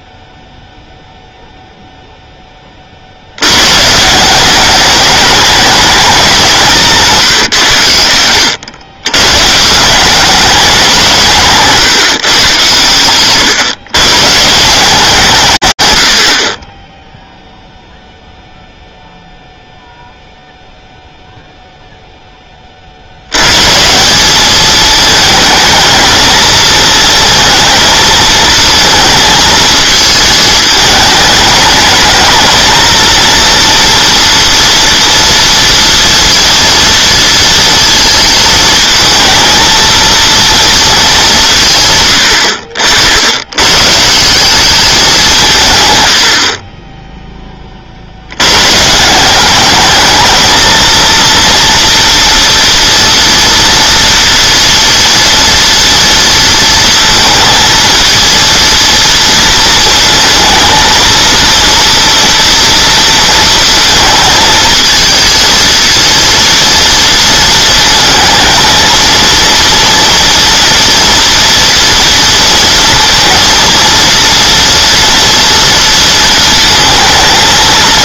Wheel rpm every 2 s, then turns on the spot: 0, 30, 190, 160, 100, 190, 120, 170, 30, 0, 0, 70, 220, 220, 230, 210, 230, 240, 230, 220, 220, 80, 190, 10, 170, 230, 230, 230, 230, 230, 230, 230, 230, 230, 230, 230, 230, 230, 220.
46-48